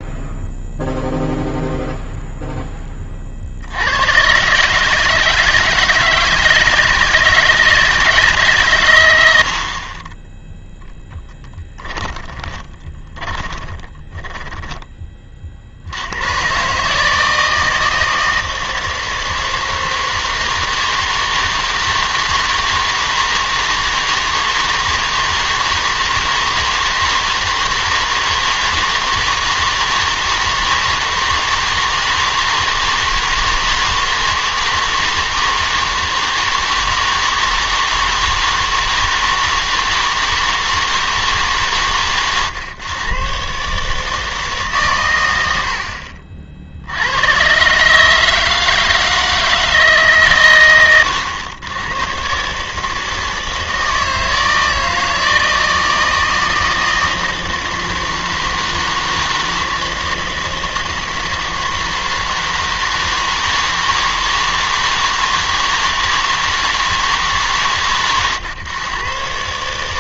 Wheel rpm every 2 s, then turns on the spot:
0, 10, 140, 160, 130, 0, 30, 10, 130, 160, 160, 160, 160, 160, 160, 160, 160, 160, 160, 160, 160, 130, 140, 60, 160, 110, 150, 160, 160, 160, 160, 160, 160, 160, 110.
12-16